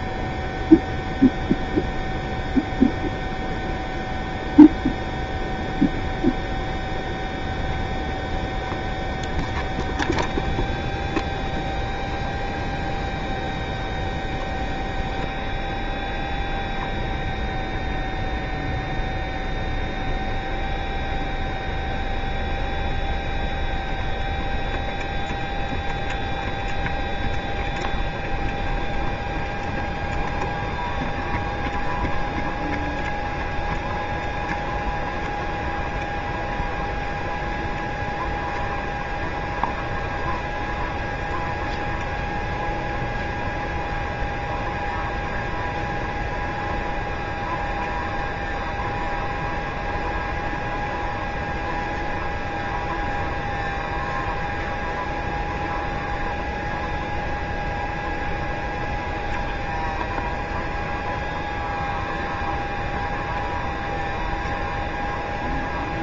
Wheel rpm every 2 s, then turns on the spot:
0, 0, 0, 0, 0, 0, 0, 0, 0, 0, 0, 0, 0, 0, 0, 0, 0, 0, 0, 0, 0, 0, 0, 0, 0, 0, 0, 0, 0, 0, 0, 0, 0.
none